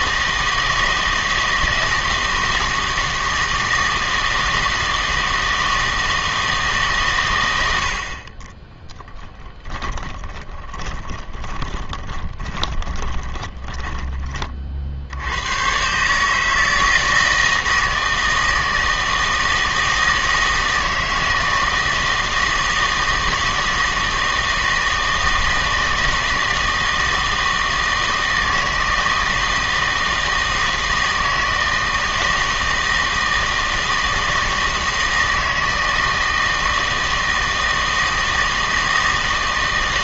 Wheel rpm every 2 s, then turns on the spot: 160, 160, 160, 150, 20, 20, 20, 40, 160, 160, 160, 160, 160, 160, 160, 160, 160, 160, 160, 160.
8-14